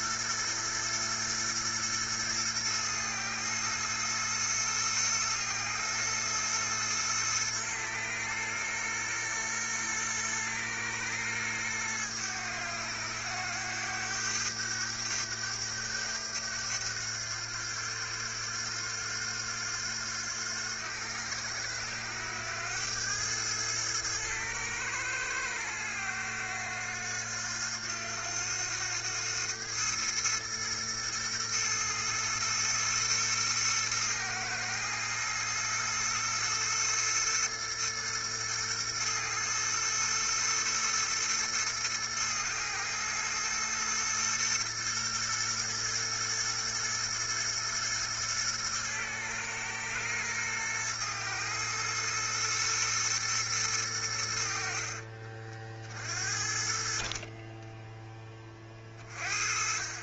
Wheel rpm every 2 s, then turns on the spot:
110, 110, 110, 110, 110, 110, 100, 100, 90, 90, 90, 100, 110, 90, 100, 110, 120, 120, 120, 110, 120, 120, 120, 120, 110, 120, 110, 50, 40, 30.
none